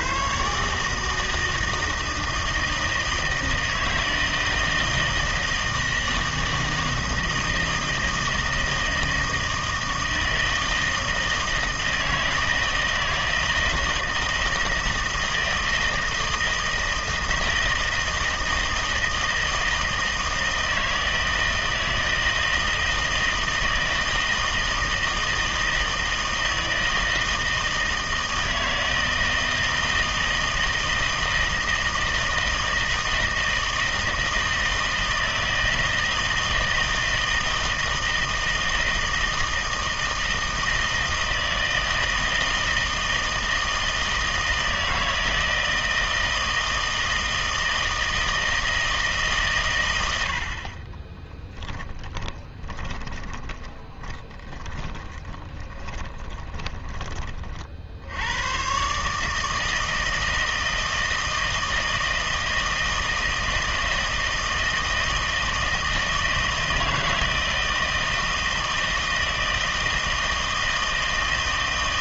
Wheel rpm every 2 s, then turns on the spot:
150, 160, 160, 160, 160, 160, 160, 160, 160, 160, 160, 160, 160, 160, 160, 160, 160, 160, 160, 160, 160, 160, 160, 160, 160, 40, 20, 20, 10, 120, 160, 160, 160, 160, 160, 160.
52-58